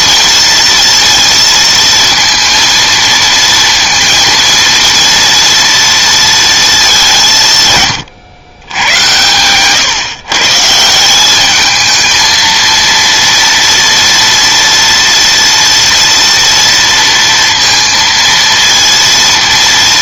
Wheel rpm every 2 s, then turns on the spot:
230, 230, 230, 210, 110, 160, 230, 230, 230, 230.
none